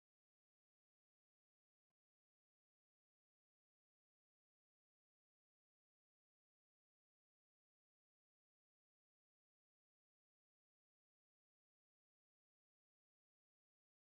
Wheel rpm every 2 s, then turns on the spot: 0, 0, 0, 0, 0, 0, 0.
none